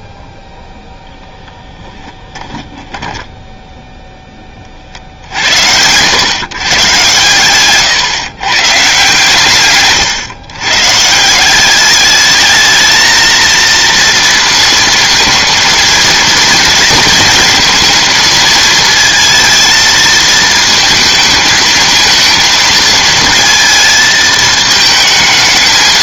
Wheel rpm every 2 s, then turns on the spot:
0, 30, 40, 130, 140, 120, 210, 230, 230, 220, 220, 220, 220.
2-4